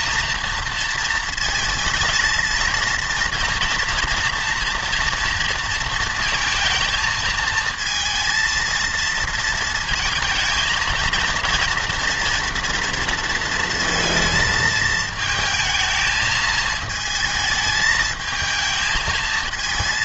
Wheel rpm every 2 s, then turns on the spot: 230, 230, 230, 220, 230, 230, 230, 220, 220, 220.
none